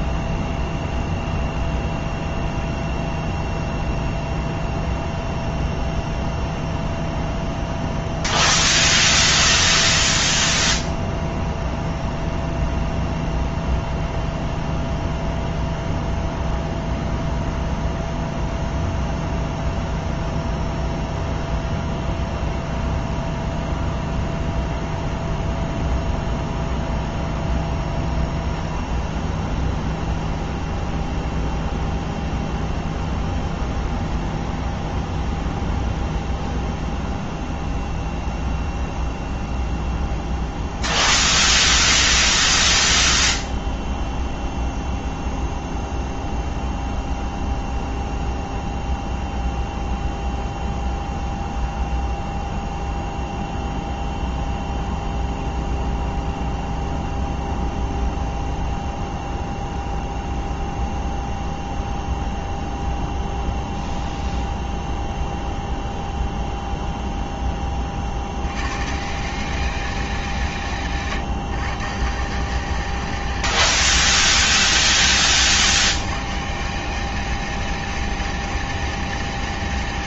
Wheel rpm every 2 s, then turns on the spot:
0, 0, 0, 0, 0, 0, 0, 0, 0, 0, 0, 0, 0, 0, 0, 0, 0, 0, 0, 0, 0, 0, 0, 0, 0, 0, 0, 0, 0, 0, 0, 0, 0, 0, 80, 170, 180, 200, 170, 210.
none